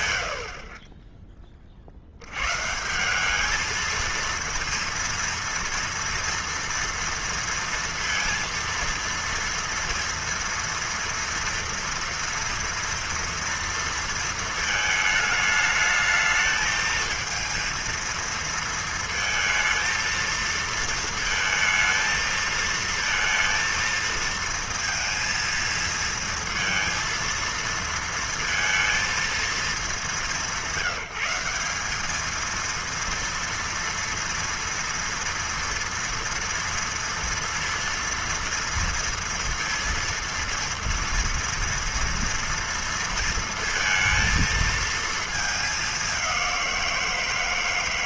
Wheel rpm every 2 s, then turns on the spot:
30, 130, 230, 230, 230, 230, 230, 220, 220, 230, 230, 230, 230, 230, 230, 200, 220, 230, 230, 230, 230, 230, 220, 190.
none